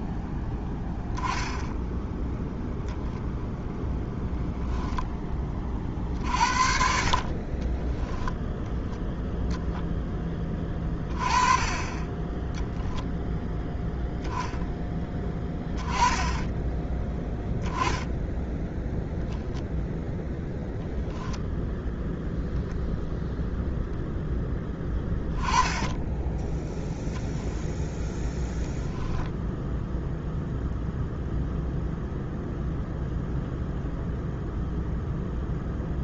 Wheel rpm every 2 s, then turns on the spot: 10, 0, 10, 60, 0, 20, 0, 10, 10, 10, 0, 0, 10, 10, 0, 0, 0, 0.
none